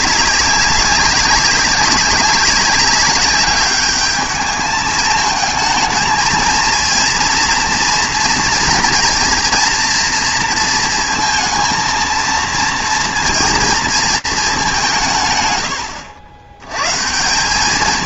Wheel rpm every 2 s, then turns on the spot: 190, 200, 210, 230, 230, 230, 230, 190, 110.
none